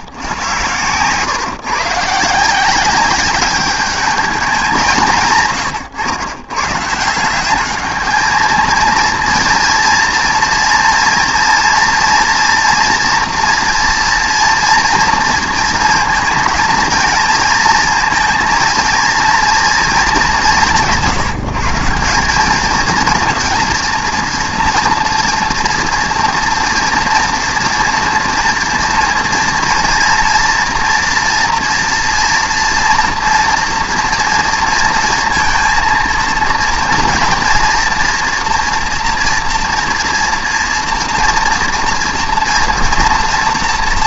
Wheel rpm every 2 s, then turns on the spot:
120, 170, 200, 130, 220, 230, 240, 240, 230, 230, 180, 200, 230, 230, 230, 240, 240, 230, 230, 240, 240, 230.
none